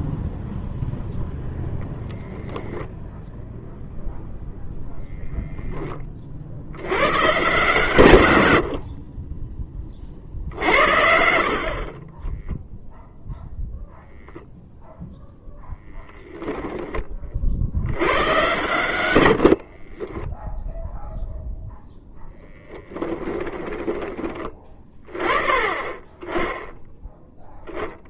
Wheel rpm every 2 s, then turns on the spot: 0, 0, 20, 130, 40, 20, 0, 0, 90, 10, 10, 20, 20, 30.
18-22 26-28